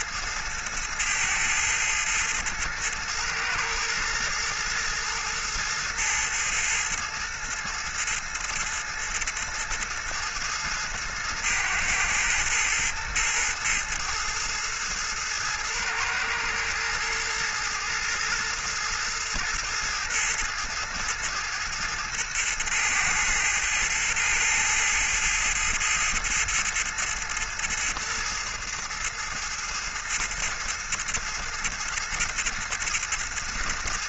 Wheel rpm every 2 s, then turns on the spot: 110, 110, 110, 110, 110, 110, 110, 110, 110, 110, 110, 110, 110, 110, 110, 110, 110.
none